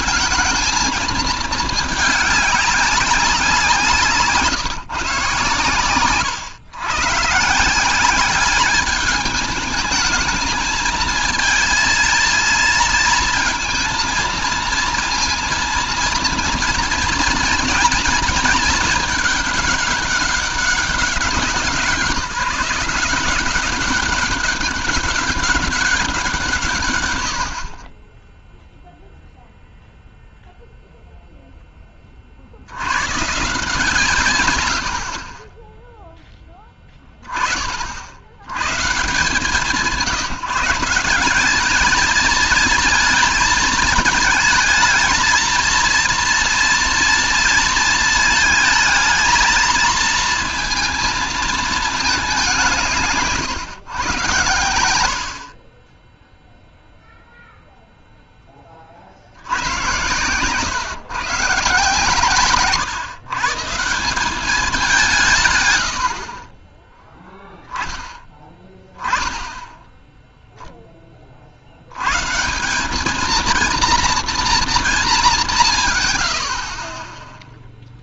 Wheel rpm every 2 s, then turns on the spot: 220, 200, 160, 110, 200, 220, 230, 230, 230, 220, 200, 170, 200, 160, 10, 0, 40, 120, 10, 100, 170, 220, 220, 230, 220, 230, 190, 100, 0, 20, 100, 140, 190, 40, 10, 10, 170, 230, 70.
none